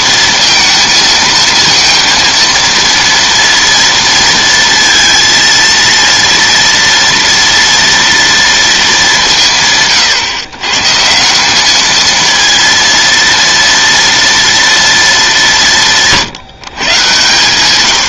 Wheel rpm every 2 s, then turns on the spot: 230, 230, 230, 230, 220, 130, 230, 230, 140.
none